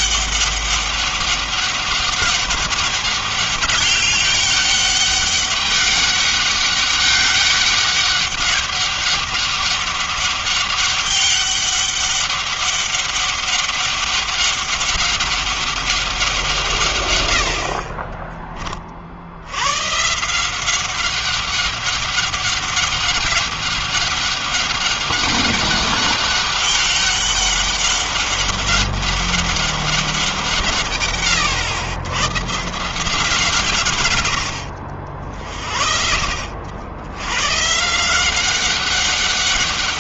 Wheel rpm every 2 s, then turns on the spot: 200, 200, 200, 200, 200, 200, 200, 200, 180, 30, 160, 200, 200, 200, 200, 170, 110, 90, 60, 170.
none